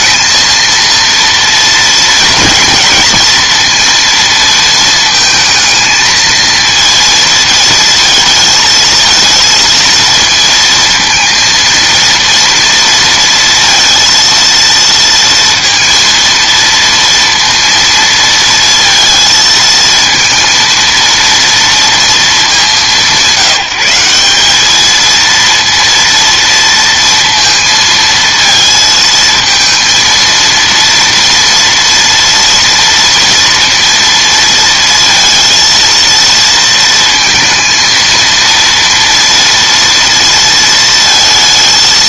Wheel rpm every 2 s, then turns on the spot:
230, 230, 220, 230, 220, 230, 230, 230, 230, 230, 230, 180, 210, 230, 230, 230, 230, 230, 230, 230, 230.
none